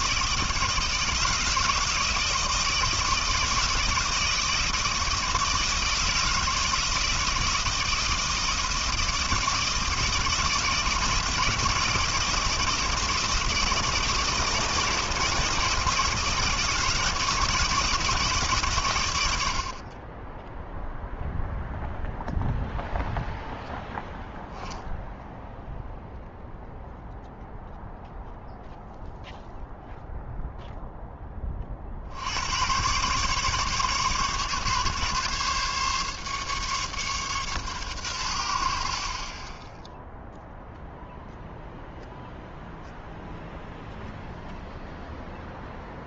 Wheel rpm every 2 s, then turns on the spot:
160, 160, 160, 160, 160, 160, 160, 160, 160, 140, 0, 0, 0, 0, 0, 0, 110, 150, 140, 70, 0, 0, 0.
none